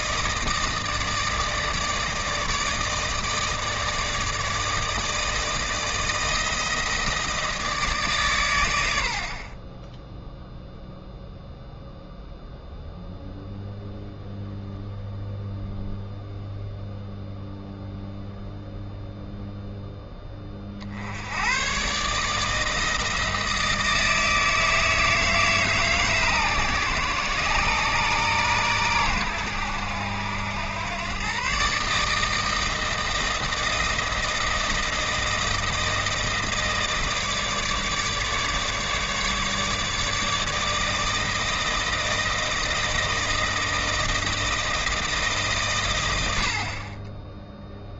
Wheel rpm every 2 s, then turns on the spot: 160, 160, 160, 160, 100, 0, 0, 0, 0, 0, 40, 160, 160, 130, 120, 100, 160, 160, 160, 150, 160, 160, 160, 110.
none